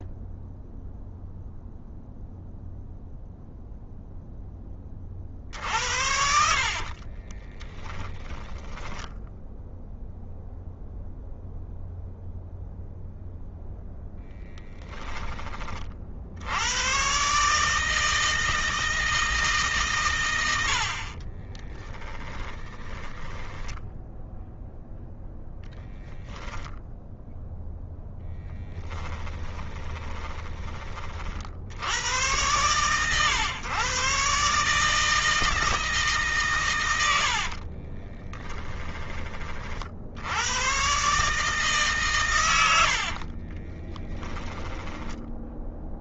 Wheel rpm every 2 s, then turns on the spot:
0, 0, 20, 40, 10, 0, 0, 10, 120, 160, 50, 30, 0, 0, 10, 40, 120, 160, 100, 20, 120, 80, 20.
6-8 20-24 28-30 42-46